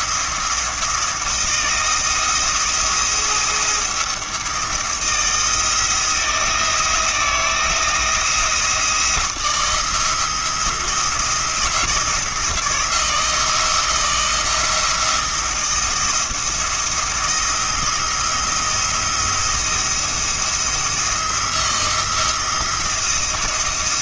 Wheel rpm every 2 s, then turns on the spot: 170, 170, 170, 170, 160, 170, 160, 170, 160, 160, 170, 170.
none